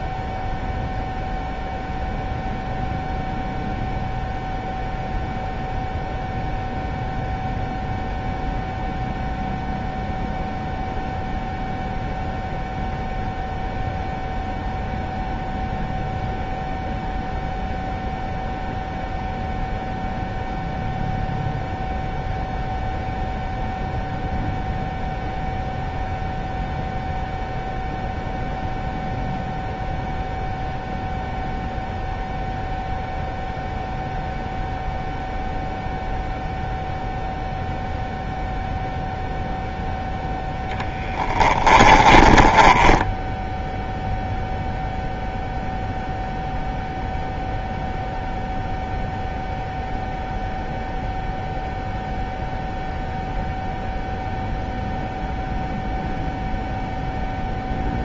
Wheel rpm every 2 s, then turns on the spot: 0, 0, 0, 0, 0, 0, 0, 0, 0, 0, 0, 0, 0, 0, 0, 0, 0, 0, 0, 0, 0, 20, 0, 0, 0, 0, 0, 0, 0.
42-44